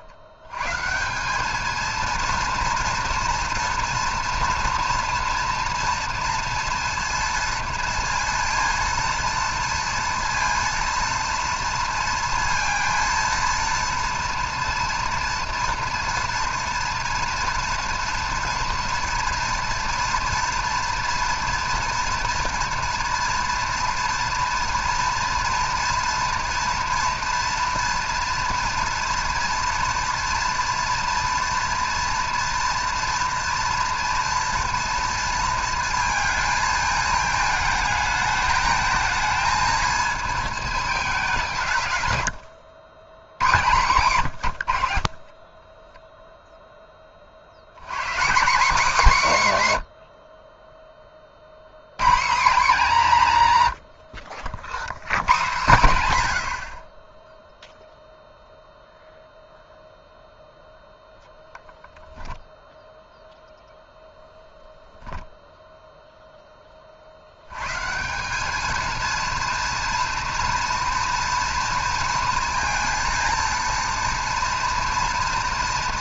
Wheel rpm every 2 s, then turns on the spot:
120, 230, 230, 230, 230, 230, 230, 230, 230, 240, 240, 230, 230, 230, 230, 230, 230, 230, 220, 220, 220, 80, 90, 10, 200, 30, 190, 80, 60, 0, 0, 0, 0, 30, 220, 230, 230, 230.
42-44